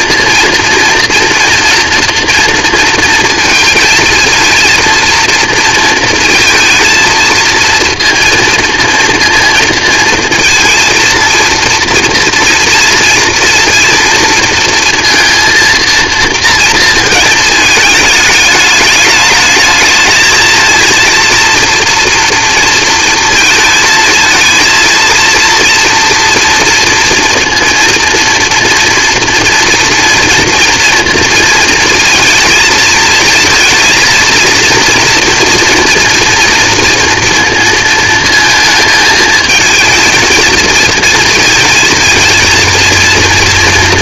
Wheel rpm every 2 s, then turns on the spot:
230, 230, 230, 230, 230, 230, 230, 230, 230, 210, 220, 230, 230, 230, 240, 230, 220, 230, 230, 230, 230, 230.
none